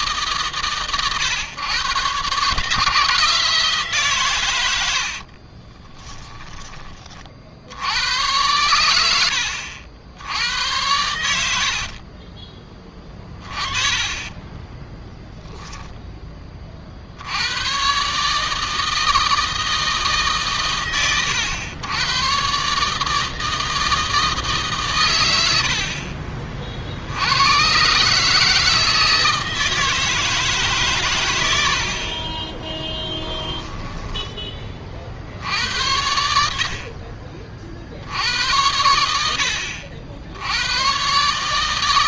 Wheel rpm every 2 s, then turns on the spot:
130, 150, 90, 20, 100, 100, 20, 20, 50, 160, 130, 130, 140, 60, 160, 140, 20, 30, 60, 80, 90.
4-6 12-16 32-34